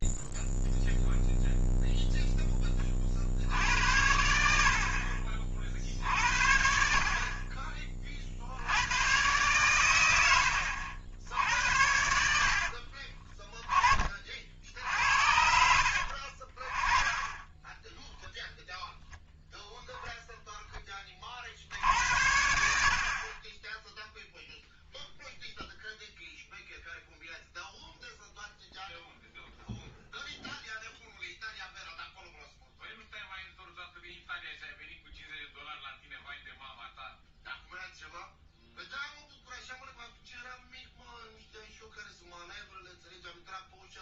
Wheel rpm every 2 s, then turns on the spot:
0, 20, 60, 60, 80, 80, 60, 60, 20, 0, 10, 70, 0, 0, 0, 0, 0, 0, 0, 0, 0, 0.
none